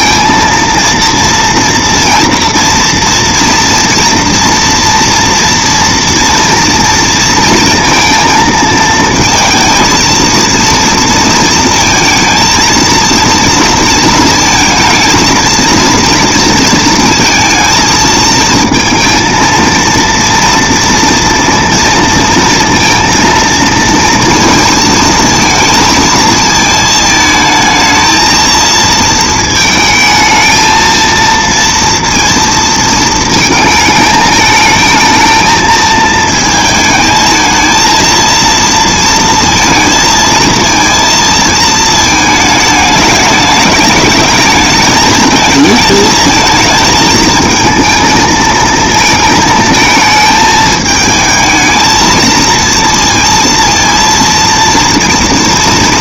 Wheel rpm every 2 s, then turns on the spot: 230, 230, 230, 230, 230, 230, 230, 230, 230, 230, 230, 230, 230, 220, 230, 220, 230, 220, 220, 230, 230, 220, 210, 220, 220, 220, 230, 230.
none